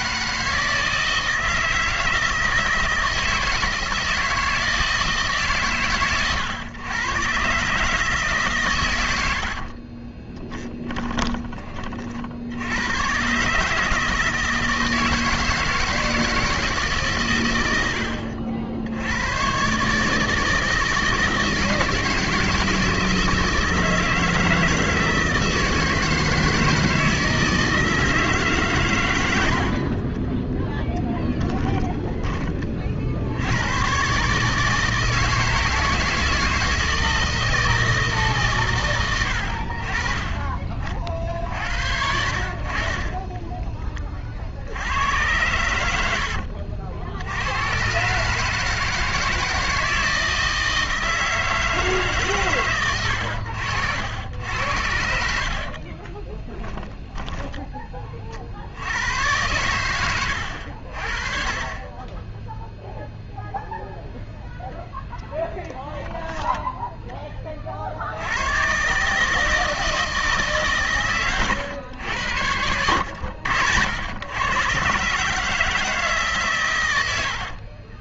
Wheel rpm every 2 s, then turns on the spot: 160, 160, 160, 120, 130, 20, 80, 160, 160, 70, 160, 160, 160, 160, 130, 10, 30, 150, 160, 140, 40, 50, 70, 70, 160, 160, 130, 80, 20, 70, 80, 0, 0, 10, 120, 140, 90, 120, 120.
10-12 30-32 56-58 66-68